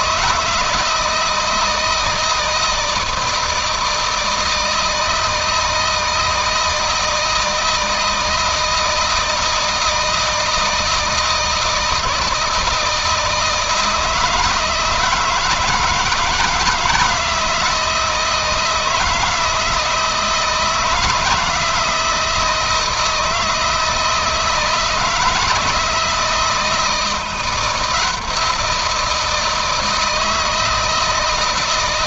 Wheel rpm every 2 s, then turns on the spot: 160, 160, 160, 160, 160, 160, 160, 160, 160, 160, 170, 170, 160, 160, 170, 160.
none